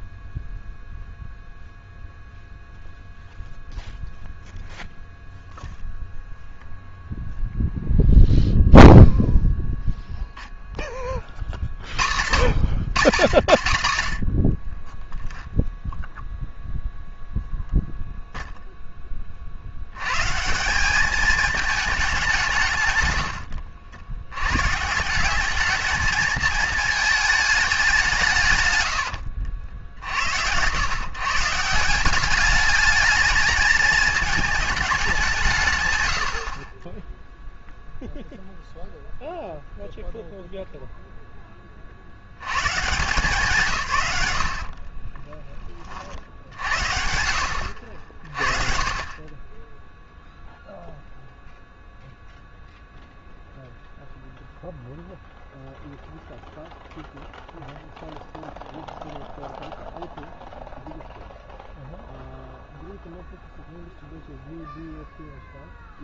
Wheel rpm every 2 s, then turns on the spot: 0, 0, 0, 0, 0, 10, 90, 30, 0, 10, 190, 150, 130, 220, 120, 110, 210, 210, 30, 0, 0, 150, 60, 70, 40, 0, 0, 0, 0, 0, 0, 0, 0.
44-46